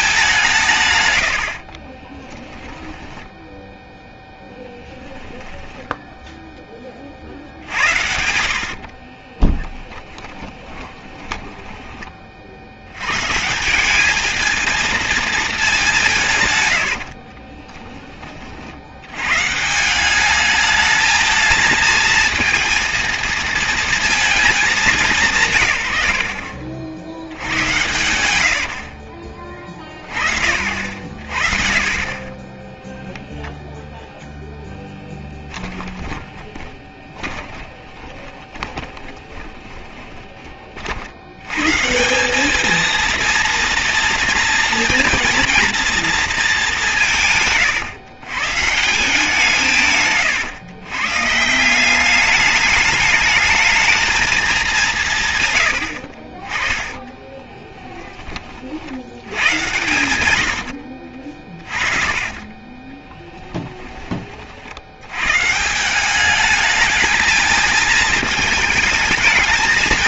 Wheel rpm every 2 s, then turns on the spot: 190, 10, 10, 10, 60, 20, 50, 220, 130, 40, 210, 230, 220, 60, 90, 50, 20, 0, 20, 20, 40, 210, 230, 210, 140, 120, 210, 210, 30, 30, 90, 30, 40, 210, 220.
2-4 8-12 28-30 36-40 60-64